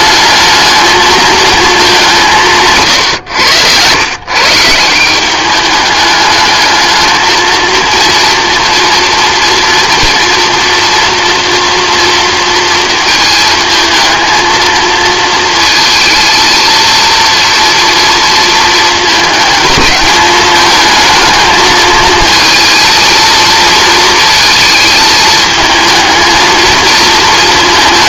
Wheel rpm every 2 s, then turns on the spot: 220, 140, 160, 220, 230, 230, 230, 230, 230, 220, 220, 230, 220, 230.
none